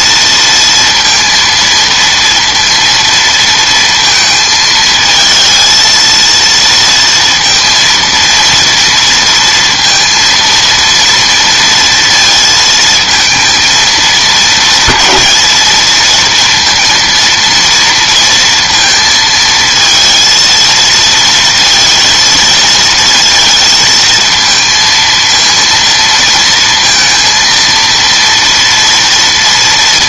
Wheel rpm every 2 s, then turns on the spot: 230, 230, 220, 230, 230, 230, 230, 220, 230, 230, 220, 220, 220, 230, 230.
none